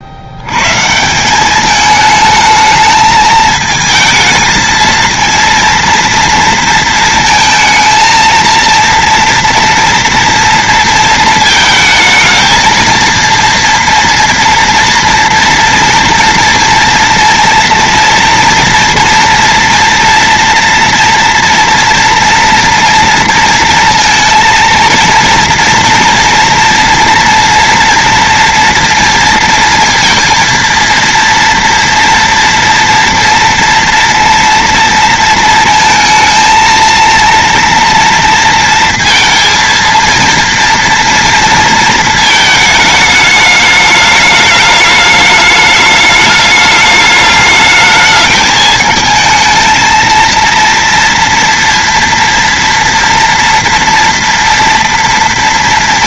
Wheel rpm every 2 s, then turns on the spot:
60, 220, 220, 230, 230, 230, 220, 240, 230, 230, 230, 240, 230, 230, 230, 230, 230, 230, 230, 230, 230, 220, 210, 210, 220, 230, 230, 230.
none